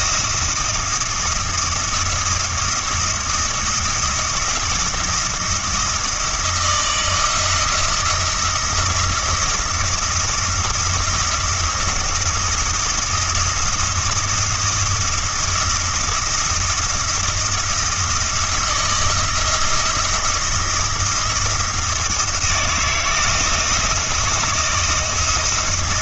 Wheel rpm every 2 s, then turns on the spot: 170, 170, 170, 170, 170, 170, 170, 170, 170, 170, 170, 170, 160.
none